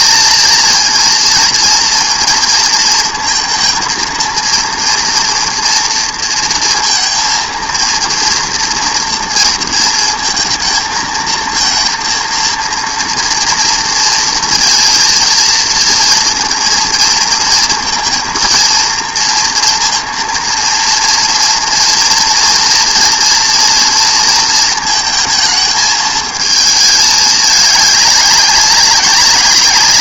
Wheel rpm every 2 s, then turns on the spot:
230, 230, 230, 230, 230, 230, 230, 230, 230, 230, 230, 230, 230, 220, 200.
none